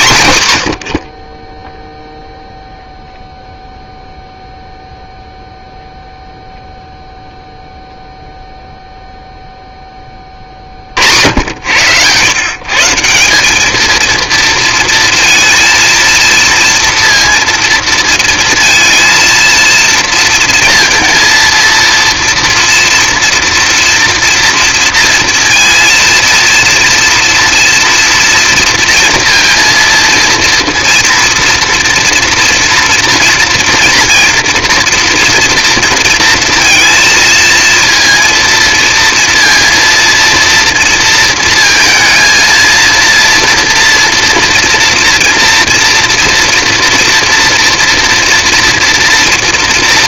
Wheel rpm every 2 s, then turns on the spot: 90, 0, 0, 0, 0, 70, 160, 230, 230, 230, 230, 230, 230, 230, 230, 230, 230, 230, 230, 230, 230, 230, 230, 230, 230.
none